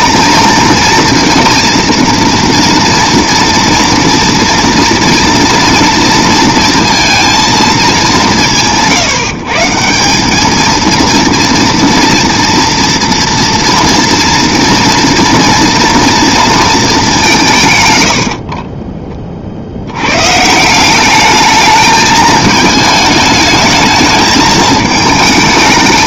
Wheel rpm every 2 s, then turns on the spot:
230, 230, 230, 230, 160, 220, 230, 230, 230, 40, 150, 220, 220.
18-20